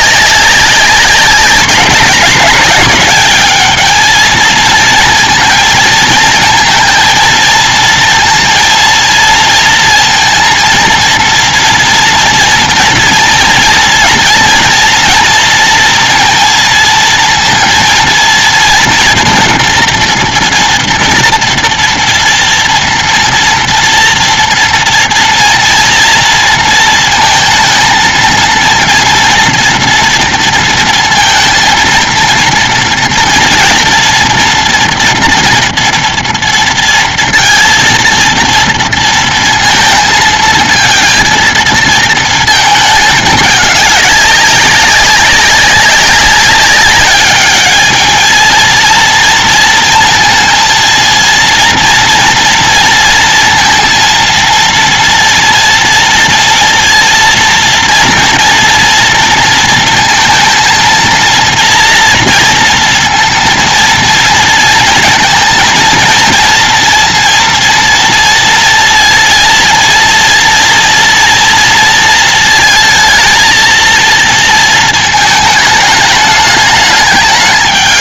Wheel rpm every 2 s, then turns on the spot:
200, 190, 220, 230, 230, 230, 230, 230, 230, 230, 230, 230, 230, 230, 230, 230, 230, 230, 230, 230, 220, 230, 200, 190, 220, 230, 230, 230, 230, 240, 230, 230, 230, 230, 230, 230, 230, 230, 210.
none